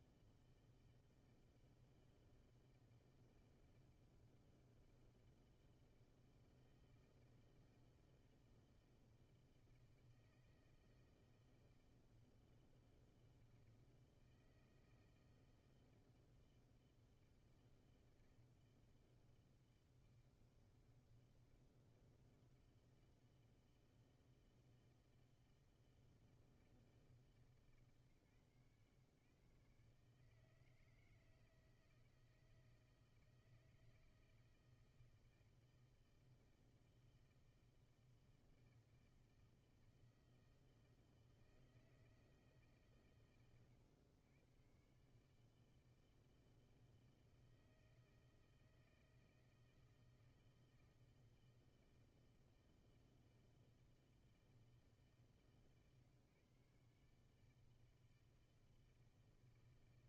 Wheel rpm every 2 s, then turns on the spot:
160, 160, 160, 160, 160, 160, 160, 160, 160, 160, 160, 160, 160, 160, 140, 160, 160, 160, 160, 160, 160, 150, 120, 160, 160, 160, 160, 160, 150, 160.
none